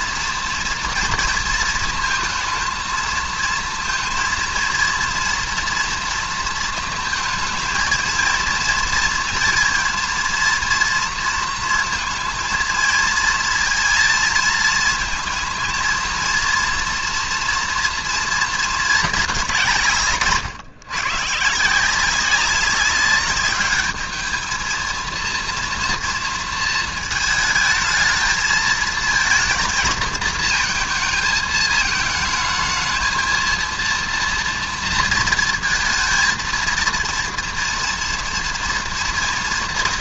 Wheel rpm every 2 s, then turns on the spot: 230, 220, 230, 230, 230, 230, 230, 220, 230, 220, 140, 200, 220, 220, 220, 220, 220, 230, 230, 230.
none